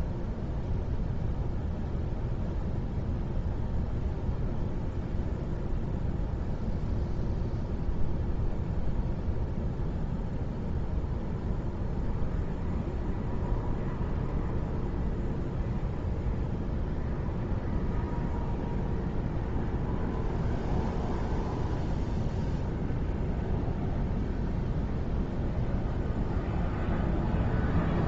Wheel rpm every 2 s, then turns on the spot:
0, 0, 0, 0, 0, 0, 0, 0, 0, 0, 0, 0, 0, 0.
none